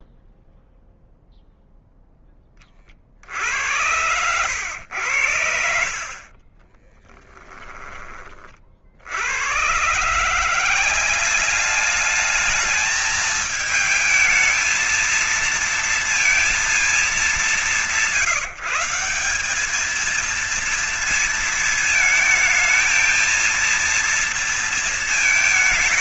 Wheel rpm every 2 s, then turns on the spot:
0, 30, 100, 30, 40, 180, 220, 220, 220, 180, 230, 220, 230.
6-8